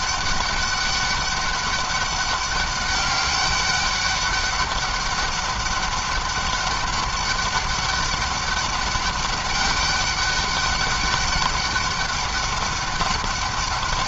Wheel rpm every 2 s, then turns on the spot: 200, 190, 200, 200, 200, 200, 200.
none